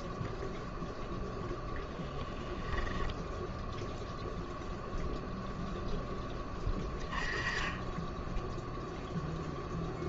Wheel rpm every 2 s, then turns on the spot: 0, 10, 0, 10, 0.
none